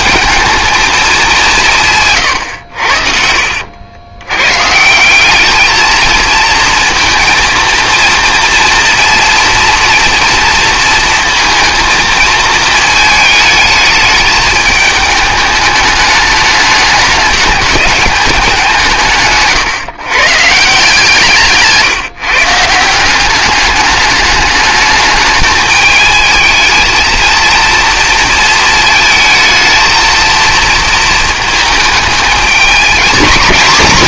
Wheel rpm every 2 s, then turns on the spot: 220, 70, 140, 230, 230, 230, 220, 210, 210, 170, 160, 170, 210, 230, 230, 220, 220.
none